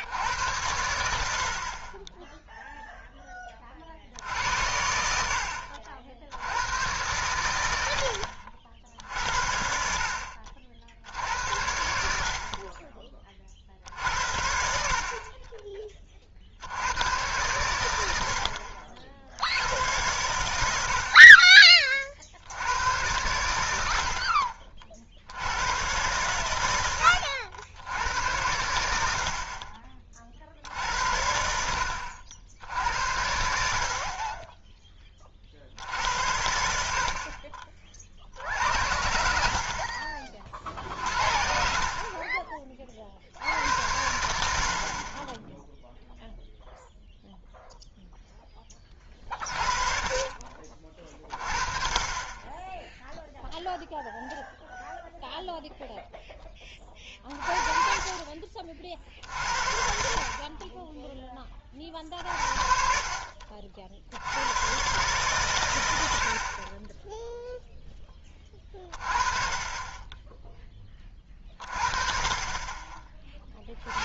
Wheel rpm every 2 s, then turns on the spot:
80, 0, 80, 100, 60, 60, 30, 70, 70, 70, 80, 80, 50, 110, 90, 60, 70, 20, 70, 70, 50, 30, 60, 0, 20, 30, 10, 0, 20, 40, 30, 50, 110, 30, 30, 10, 30.
none